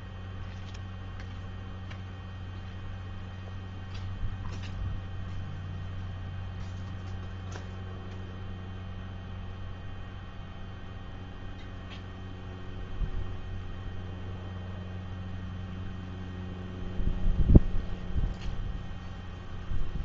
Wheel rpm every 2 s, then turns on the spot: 0, 0, 0, 0, 0, 0, 0, 0, 0, 0.
none